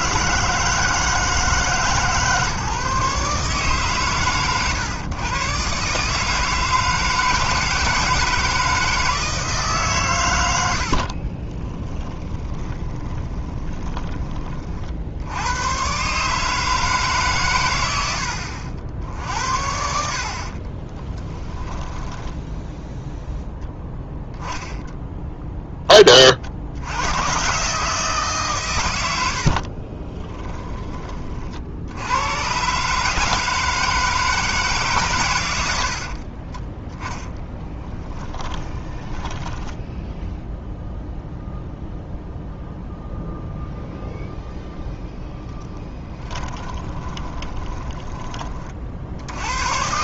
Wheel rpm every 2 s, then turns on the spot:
160, 140, 120, 160, 160, 80, 20, 40, 150, 60, 40, 10, 0, 70, 110, 10, 130, 150, 20, 10, 0, 0, 0, 20, 40.
10-14 20-24 38-40 46-48